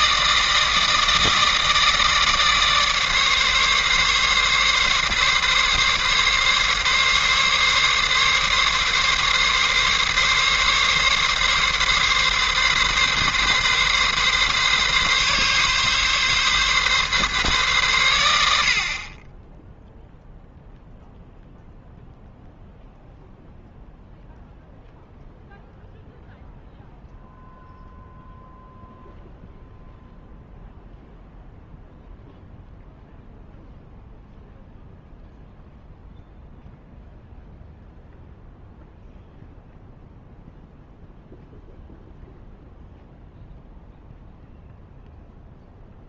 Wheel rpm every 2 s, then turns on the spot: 160, 150, 140, 140, 140, 140, 140, 140, 140, 70, 0, 0, 0, 0, 0, 0, 0, 0, 0, 0, 0, 0, 0.
none